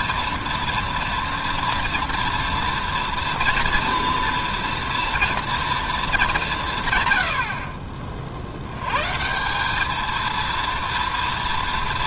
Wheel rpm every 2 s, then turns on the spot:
230, 240, 230, 150, 80, 230.
none